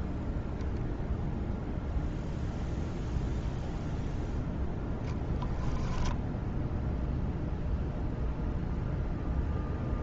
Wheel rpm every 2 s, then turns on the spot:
0, 0, 0, 0, 0.
none